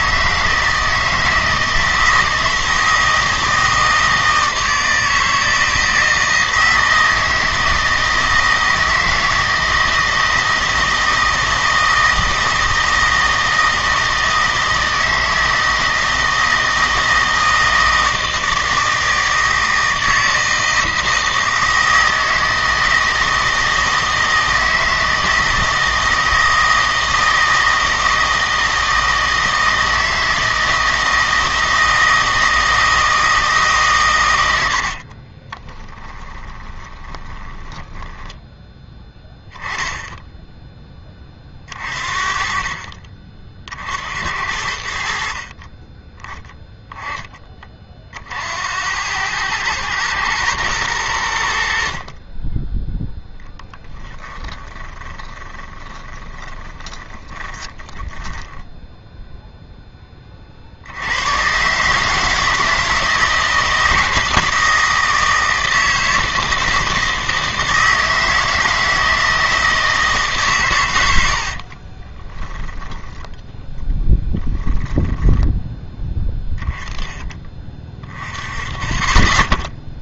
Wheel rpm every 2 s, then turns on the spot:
160, 160, 160, 160, 160, 160, 160, 160, 160, 160, 160, 160, 160, 160, 160, 160, 160, 60, 30, 10, 10, 40, 70, 10, 80, 110, 10, 20, 20, 10, 60, 160, 160, 160, 160, 110, 10, 10, 10, 30.
34-38 54-60 72-74